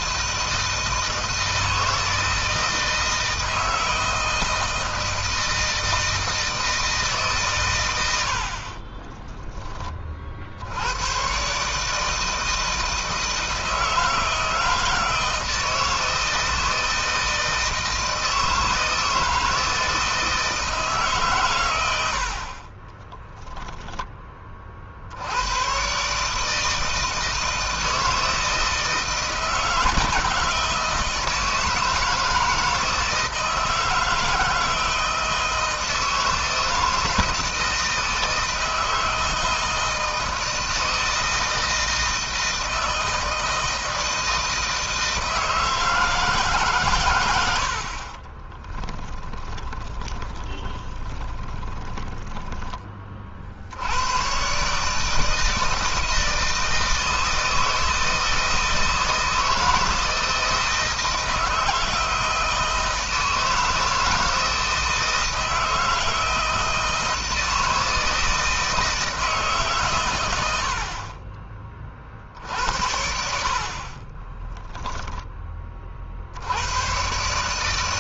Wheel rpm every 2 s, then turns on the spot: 160, 160, 160, 150, 40, 100, 160, 160, 160, 160, 150, 30, 60, 160, 160, 160, 160, 160, 160, 160, 160, 160, 160, 120, 20, 20, 30, 150, 160, 160, 160, 160, 160, 160, 160, 50, 70, 10, 110.
8-10 22-24 48-52